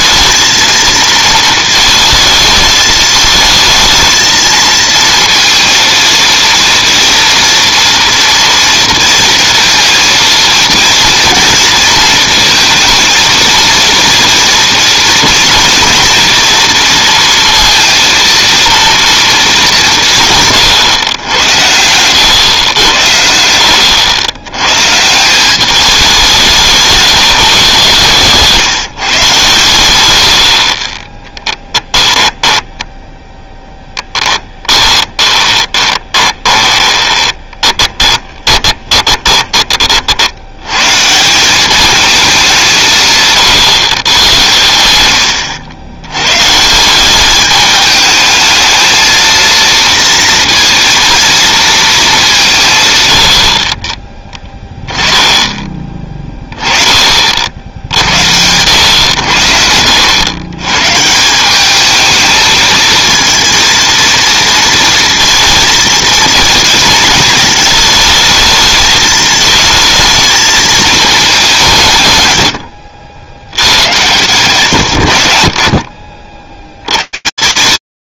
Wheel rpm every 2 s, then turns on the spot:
220, 220, 230, 230, 230, 230, 220, 230, 230, 230, 130, 110, 120, 170, 160, 50, 10, 10, 20, 20, 120, 170, 100, 150, 220, 230, 140, 20, 20, 90, 120, 220, 230, 230, 220, 220, 100, 110, 130.
32-40 74-76